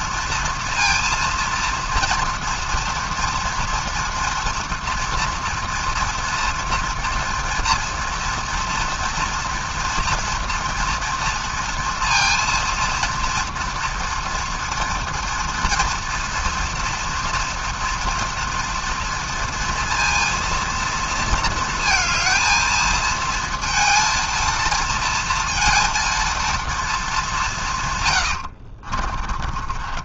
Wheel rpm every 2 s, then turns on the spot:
230, 230, 230, 230, 230, 230, 230, 240, 230, 230, 230, 220, 230, 230, 80.
28-30